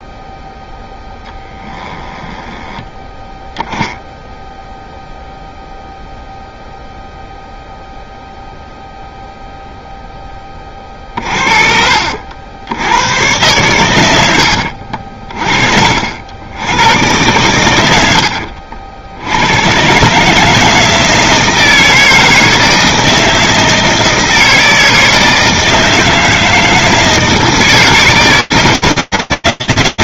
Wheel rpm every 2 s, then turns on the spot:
10, 10, 0, 0, 0, 40, 100, 50, 110, 80, 160, 160, 160, 160, 160.
0-2